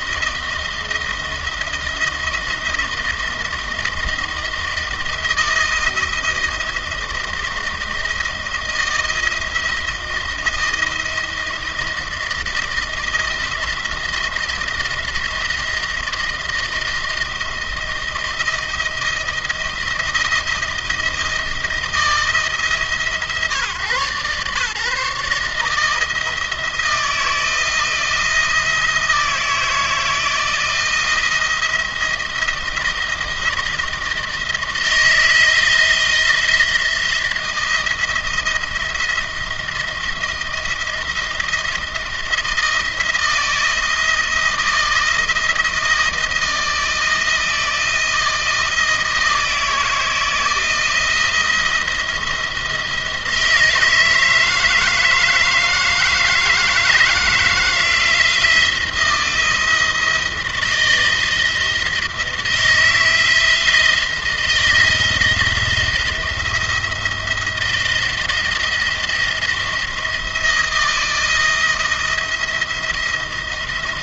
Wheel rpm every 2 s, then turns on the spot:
160, 170, 170, 160, 160, 170, 160, 160, 170, 170, 160, 160, 150, 160, 160, 160, 170, 160, 170, 170, 170, 170, 170, 170, 170, 170, 170, 160, 160, 170, 170, 160, 160, 170, 170, 170, 160.
none